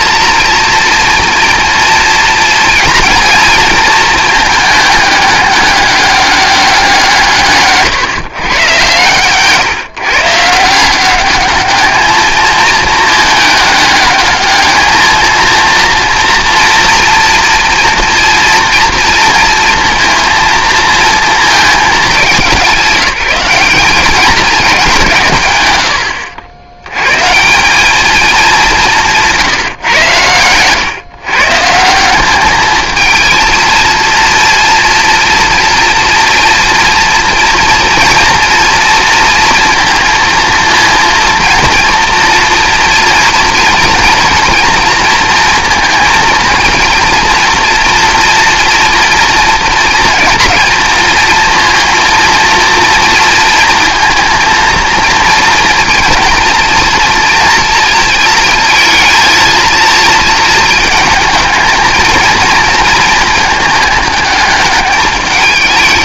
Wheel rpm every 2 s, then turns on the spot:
230, 230, 210, 180, 120, 170, 220, 220, 230, 230, 230, 200, 190, 100, 190, 120, 210, 240, 240, 230, 230, 240, 230, 230, 230, 230, 230, 230, 240, 230, 220, 230, 210.
none